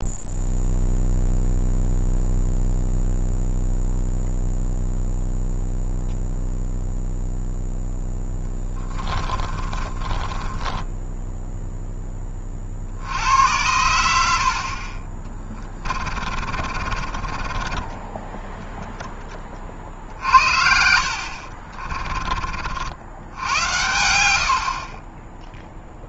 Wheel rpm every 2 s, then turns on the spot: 0, 0, 0, 0, 10, 10, 60, 40, 50, 10, 60, 60, 40.
8-12 16-18